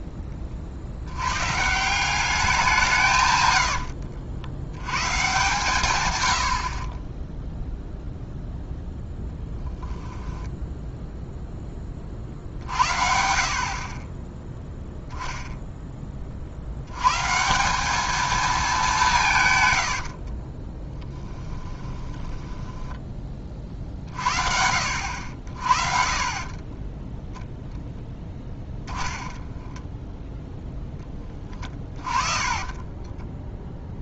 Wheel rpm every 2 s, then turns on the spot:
30, 170, 100, 40, 0, 0, 60, 10, 70, 210, 20, 10, 70, 20, 10, 0, 20.
20-24 26-30 32-34